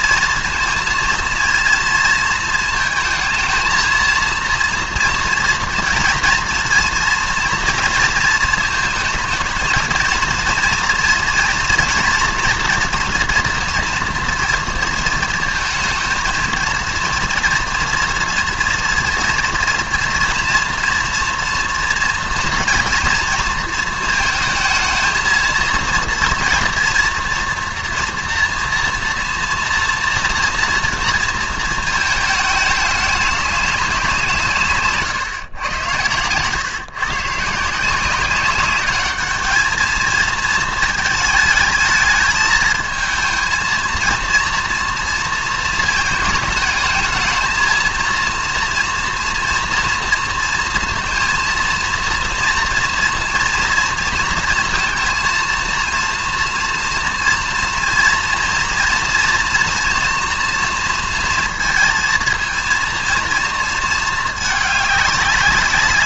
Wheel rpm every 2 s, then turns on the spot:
230, 230, 230, 240, 230, 230, 230, 230, 230, 230, 230, 230, 220, 230, 240, 230, 210, 150, 130, 190, 220, 220, 230, 210, 230, 230, 230, 230, 230, 230, 230, 230, 210.
none